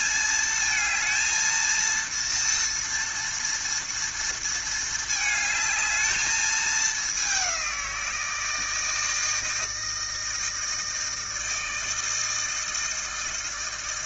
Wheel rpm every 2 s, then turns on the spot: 220, 230, 220, 210, 160, 160, 160.
none